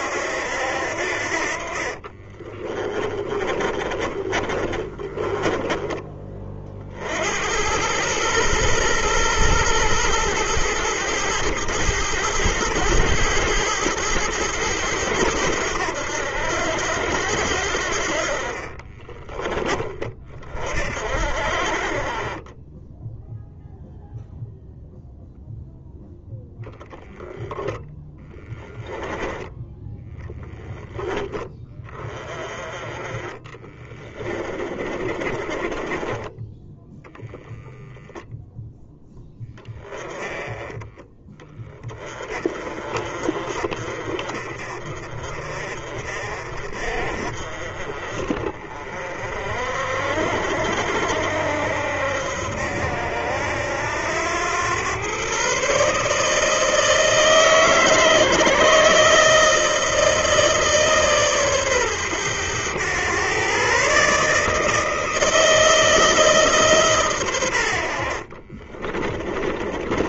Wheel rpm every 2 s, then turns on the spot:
70, 30, 30, 50, 120, 110, 110, 100, 90, 30, 50, 10, 0, 0, 10, 10, 20, 20, 0, 0, 20, 40, 40, 40, 50, 70, 70, 110, 160, 150, 150, 110, 160, 140, 20.
2-6 18-20 34-36 68-70